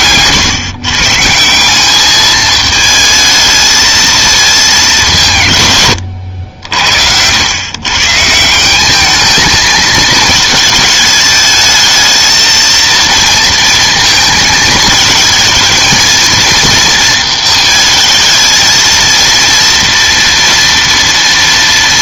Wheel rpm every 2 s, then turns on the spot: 140, 220, 210, 70, 180, 220, 220, 220, 230, 220, 230.
none